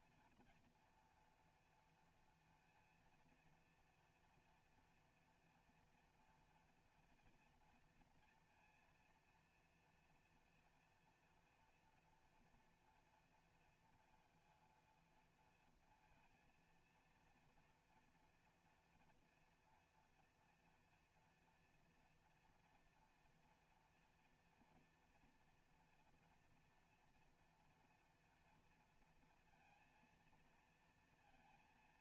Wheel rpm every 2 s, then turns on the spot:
230, 230, 230, 240, 230, 230, 240, 230, 230, 230, 240, 230, 230, 230, 230, 230.
none